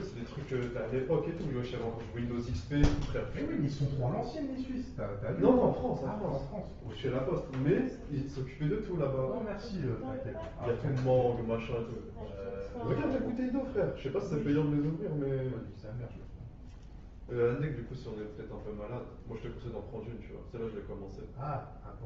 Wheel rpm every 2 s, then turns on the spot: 0, 0, 0, 0, 0, 0, 0, 0, 0, 0, 0.
none